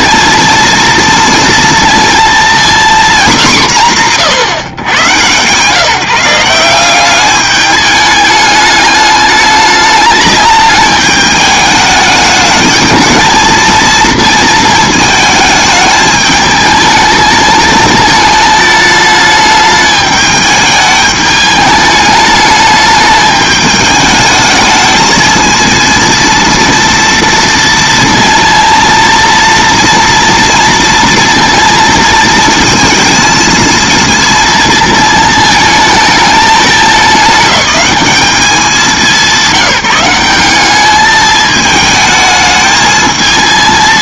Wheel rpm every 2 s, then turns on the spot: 230, 230, 110, 180, 210, 210, 210, 220, 220, 220, 210, 210, 220, 230, 230, 230, 230, 230, 210, 190, 200, 220.
none